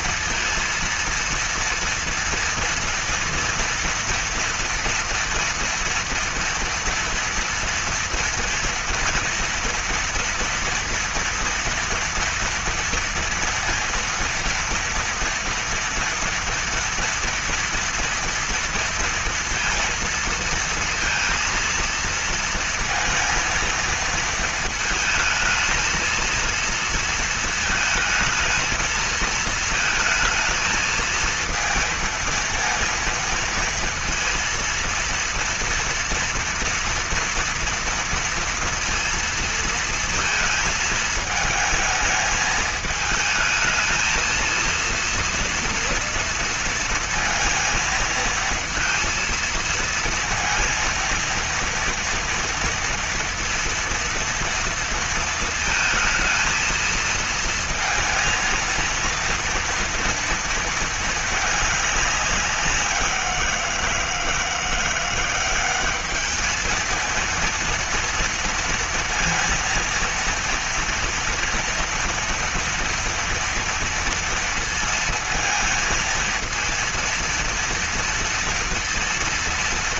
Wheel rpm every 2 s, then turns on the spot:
230, 230, 230, 230, 230, 230, 230, 230, 230, 230, 230, 230, 230, 230, 220, 230, 230, 230, 230, 230, 220, 220, 230, 230, 230, 230, 230, 230, 220, 230, 230, 190, 170, 220, 230, 230, 230, 230, 230, 230.
none